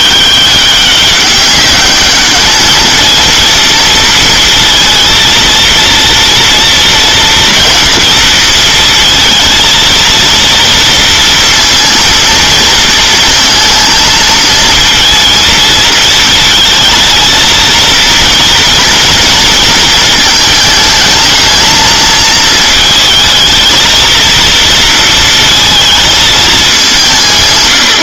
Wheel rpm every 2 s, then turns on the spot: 200, 210, 230, 230, 230, 230, 230, 230, 220, 230, 220, 220, 230, 210.
none